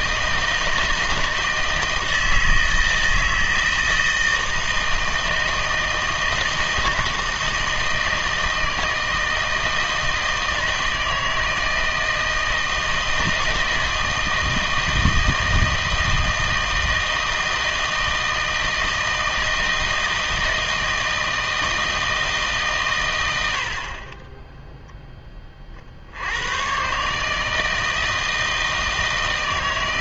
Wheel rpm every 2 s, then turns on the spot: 160, 160, 160, 160, 160, 160, 160, 160, 160, 160, 160, 130, 0, 110, 160.
none